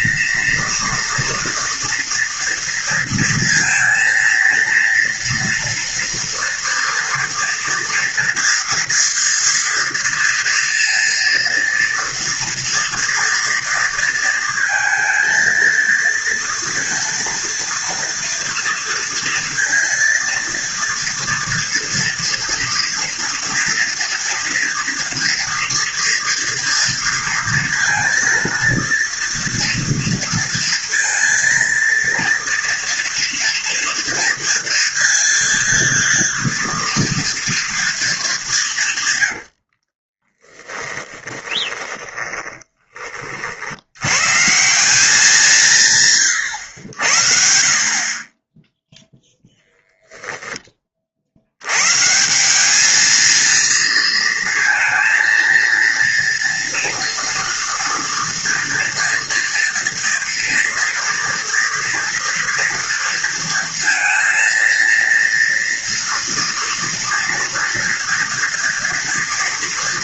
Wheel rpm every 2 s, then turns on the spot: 230, 230, 230, 230, 230, 230, 230, 230, 230, 230, 230, 240, 230, 230, 230, 230, 230, 230, 230, 180, 20, 20, 160, 100, 10, 20, 200, 230, 230, 230, 230, 230, 230, 230, 230.
40-44